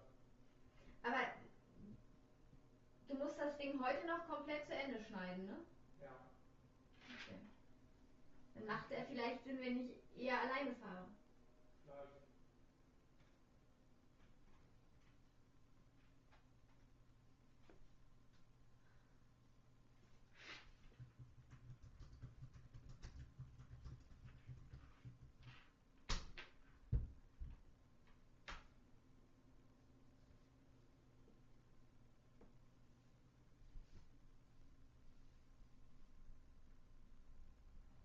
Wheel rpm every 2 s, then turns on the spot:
0, 0, 0, 0, 0, 0, 0, 0, 0, 0, 0, 0, 0, 0, 0, 0, 0, 0, 0.
none